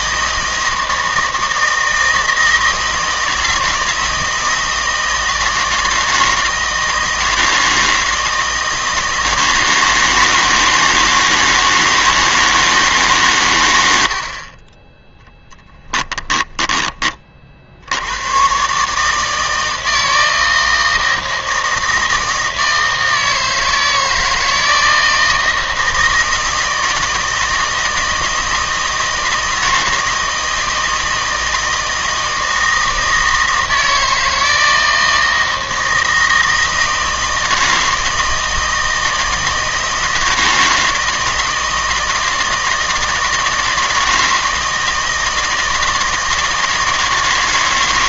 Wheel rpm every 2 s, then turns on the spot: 160, 160, 160, 160, 160, 160, 150, 20, 20, 130, 160, 160, 160, 160, 160, 160, 160, 160, 160, 160, 160, 160, 160, 160.
14-18